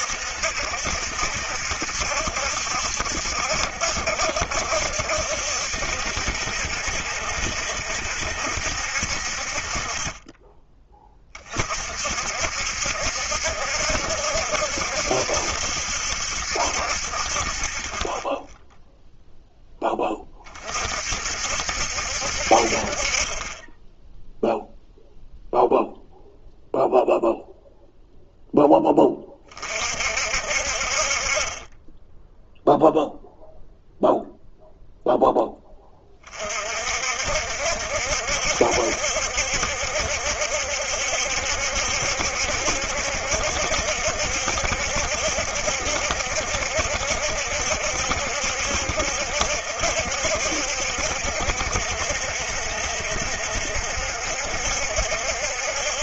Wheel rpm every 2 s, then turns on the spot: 70, 70, 70, 70, 60, 20, 70, 70, 50, 0, 50, 40, 0, 0, 20, 50, 0, 0, 50, 70, 70, 70, 70, 70, 70, 70, 70, 70.
none